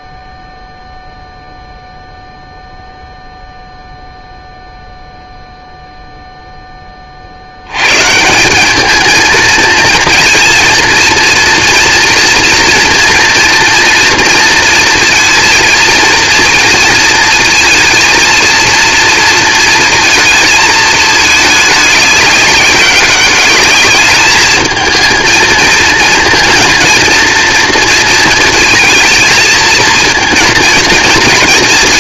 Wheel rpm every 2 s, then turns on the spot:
0, 0, 0, 70, 230, 230, 230, 230, 230, 230, 210, 200, 230, 230, 230, 230.
none